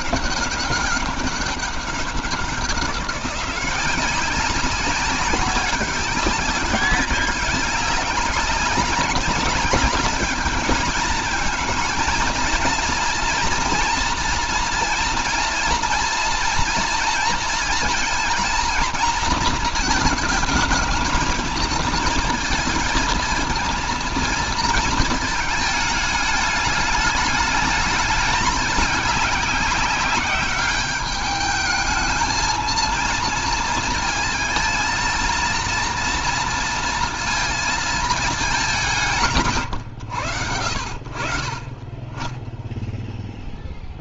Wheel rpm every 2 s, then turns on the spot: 200, 180, 190, 190, 200, 210, 230, 230, 230, 230, 220, 230, 230, 210, 210, 200, 220, 230, 230, 190, 70, 10.
none